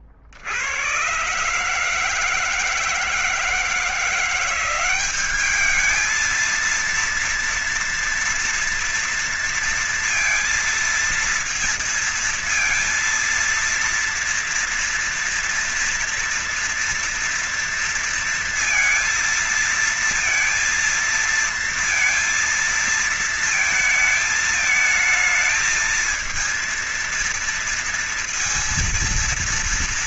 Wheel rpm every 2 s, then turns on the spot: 60, 160, 180, 220, 230, 230, 230, 240, 230, 230, 230, 230, 220, 230, 230.
none